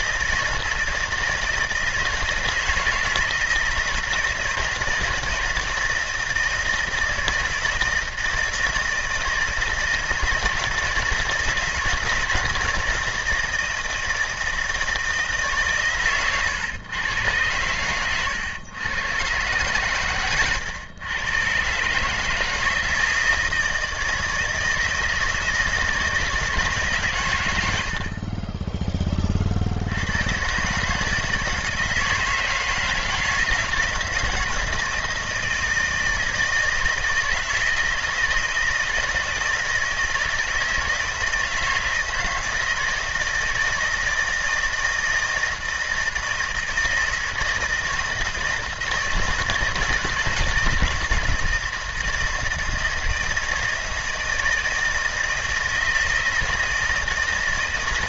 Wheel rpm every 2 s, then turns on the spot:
160, 160, 160, 160, 160, 170, 160, 160, 110, 120, 110, 160, 160, 140, 20, 150, 160, 160, 160, 160, 160, 160, 160, 160, 160, 160, 160, 160, 160.
none